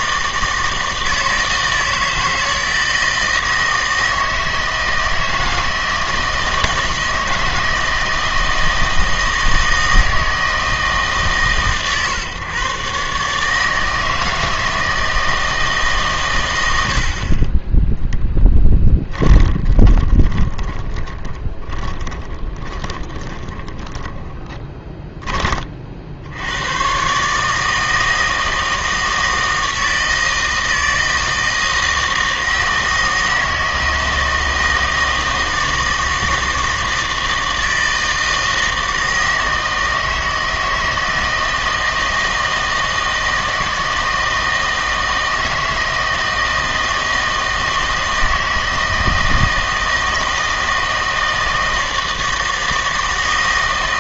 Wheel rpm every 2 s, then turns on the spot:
160, 160, 160, 160, 160, 160, 130, 160, 90, 10, 20, 10, 20, 100, 160, 160, 160, 160, 160, 160, 160, 160, 160, 160, 160, 160, 160.
18-26